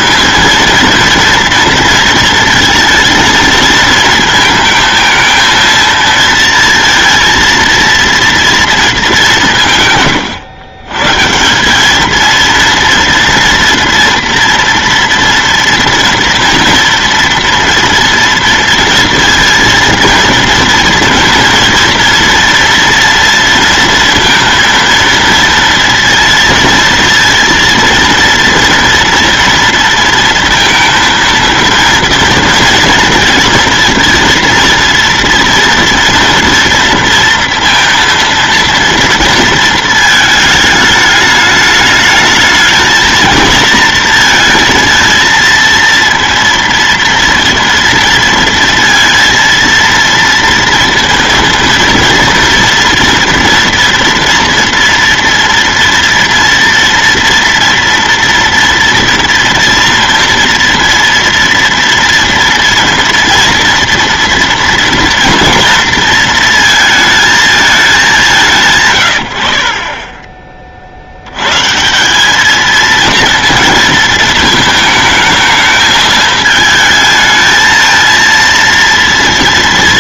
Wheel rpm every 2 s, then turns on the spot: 230, 230, 220, 230, 220, 120, 230, 230, 230, 230, 230, 230, 230, 230, 230, 230, 230, 230, 230, 230, 210, 220, 230, 230, 230, 230, 230, 240, 230, 230, 240, 230, 240, 230, 150, 40, 220, 220, 220, 230.
none